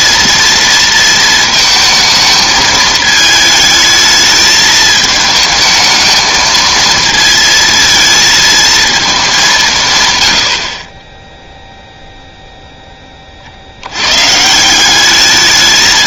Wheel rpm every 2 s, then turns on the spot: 230, 220, 220, 220, 220, 70, 10, 180.
none